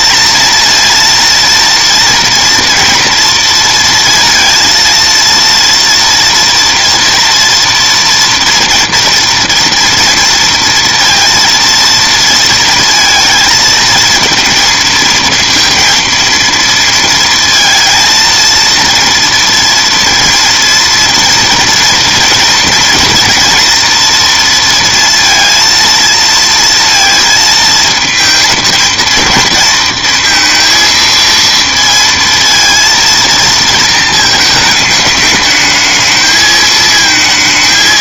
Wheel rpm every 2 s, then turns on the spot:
230, 230, 230, 230, 230, 230, 230, 230, 230, 230, 230, 230, 230, 230, 220, 230, 230, 210, 220.
none